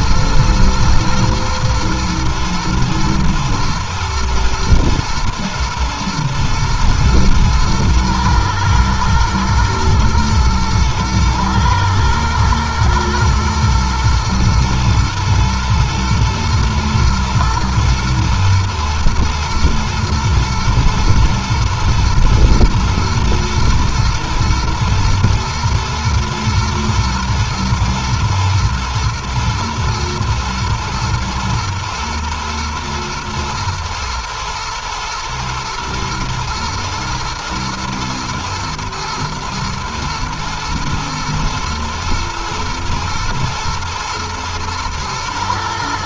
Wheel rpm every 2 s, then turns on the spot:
120, 120, 120, 110, 110, 110, 120, 110, 110, 120, 120, 120, 110, 110, 120, 110, 110, 120, 110, 110, 110, 120, 110.
none